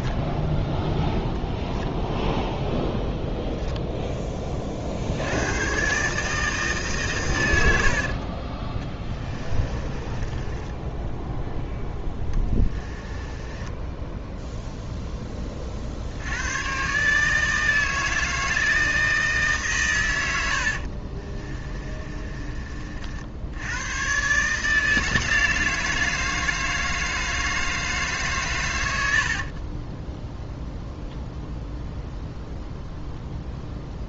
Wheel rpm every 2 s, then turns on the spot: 10, 0, 30, 150, 20, 10, 10, 0, 110, 160, 60, 50, 150, 160, 120, 0, 0.
8-14 20-22